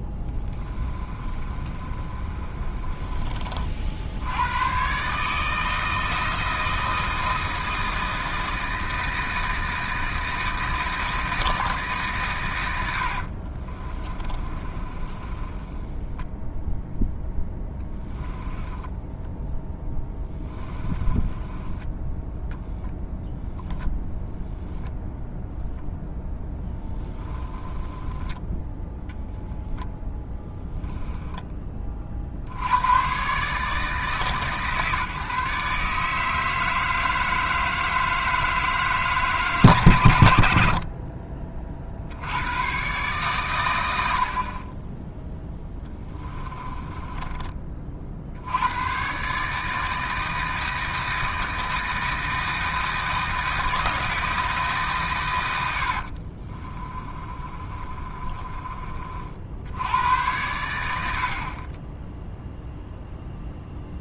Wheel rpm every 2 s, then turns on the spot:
20, 30, 130, 160, 160, 160, 80, 20, 0, 10, 20, 0, 0, 10, 10, 20, 100, 150, 160, 160, 60, 120, 20, 20, 100, 160, 160, 140, 30, 30, 80, 0.
0-4 14-16 18-22 26-28 30-32 56-58